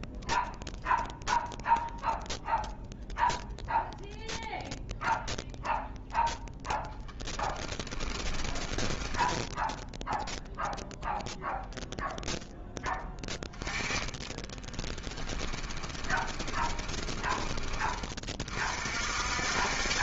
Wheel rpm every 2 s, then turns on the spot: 0, 0, 0, 0, 10, 0, 0, 20, 20, 40.
8-10 14-18